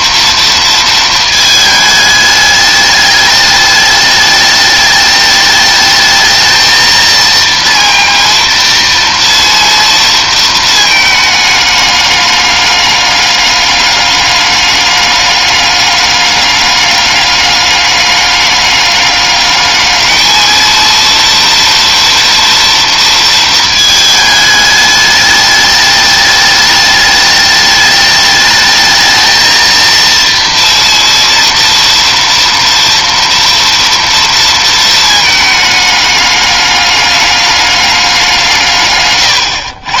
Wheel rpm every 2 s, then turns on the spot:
230, 210, 210, 220, 230, 230, 210, 210, 200, 200, 220, 230, 210, 210, 210, 230, 230, 230, 210, 180.
none